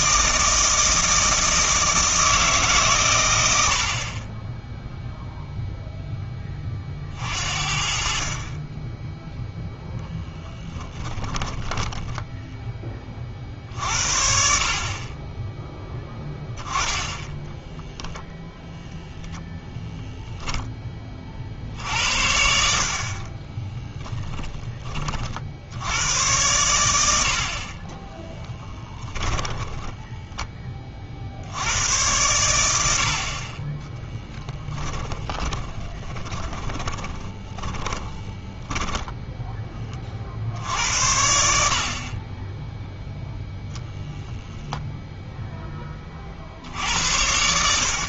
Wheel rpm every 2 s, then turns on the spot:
160, 140, 10, 40, 20, 10, 10, 50, 10, 0, 10, 60, 20, 90, 10, 20, 90, 10, 20, 10, 80, 10, 0, 70.
10-12 28-30 34-38